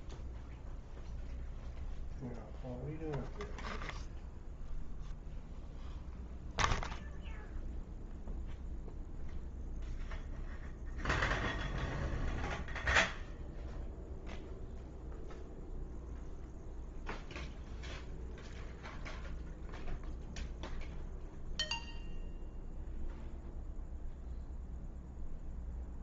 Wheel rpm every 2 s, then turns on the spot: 0, 0, 0, 0, 0, 0, 0, 0, 0, 0, 0, 0, 0.
none